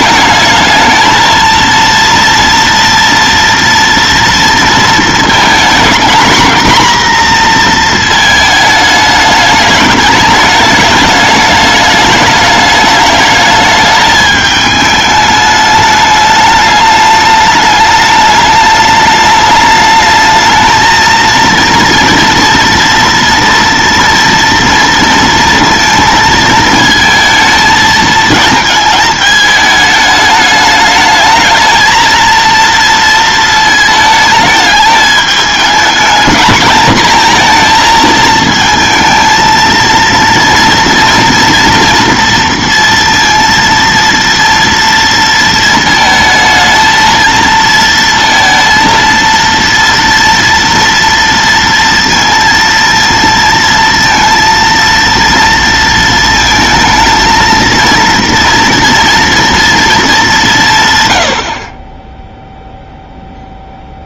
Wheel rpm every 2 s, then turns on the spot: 220, 230, 230, 240, 220, 210, 210, 220, 210, 210, 220, 230, 230, 220, 220, 210, 230, 220, 230, 220, 230, 230, 230, 220, 230, 230, 230, 230, 220, 230, 170, 0.
none